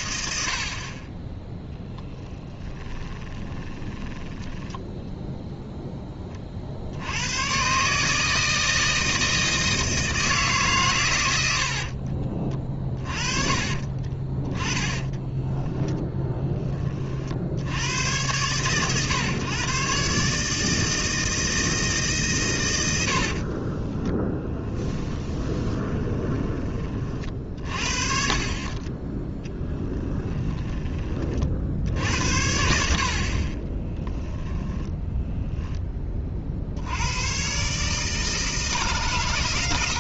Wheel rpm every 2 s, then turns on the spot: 10, 20, 0, 120, 160, 70, 40, 10, 50, 120, 160, 60, 20, 40, 10, 30, 50, 10, 90, 140.
2-4 10-16 22-26 34-36